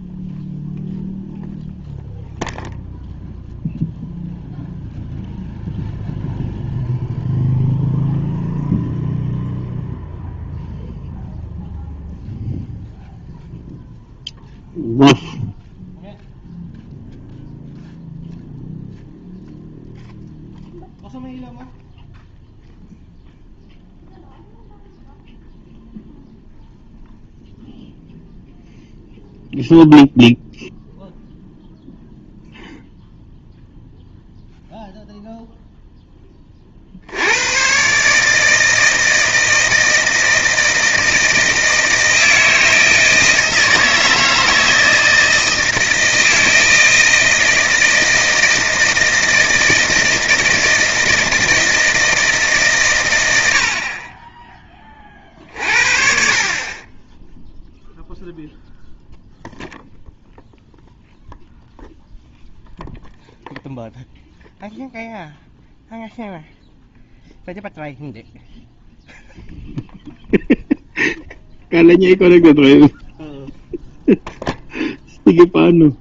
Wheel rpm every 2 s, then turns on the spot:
0, 0, 0, 0, 0, 0, 0, 0, 0, 0, 0, 0, 0, 0, 0, 0, 0, 0, 40, 160, 160, 160, 160, 160, 160, 160, 140, 20, 30, 0, 0, 0, 0, 0, 0, 0, 0, 0.
none